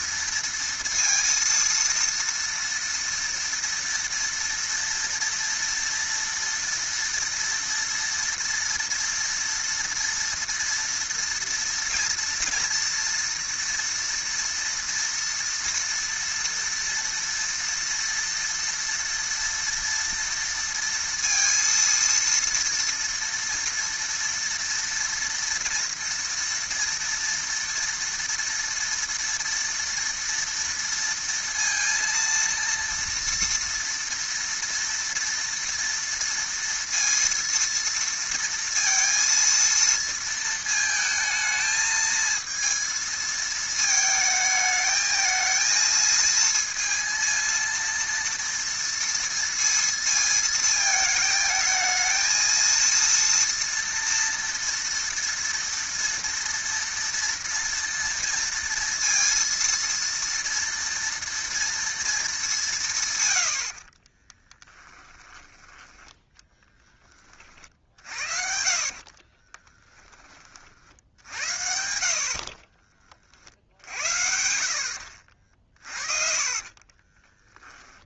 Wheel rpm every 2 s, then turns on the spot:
230, 230, 230, 230, 230, 230, 230, 230, 230, 230, 230, 230, 230, 230, 230, 230, 230, 230, 230, 230, 230, 220, 220, 230, 230, 220, 220, 230, 230, 230, 230, 200, 20, 10, 50, 30, 40, 70, 40.
64-66 68-70 76-78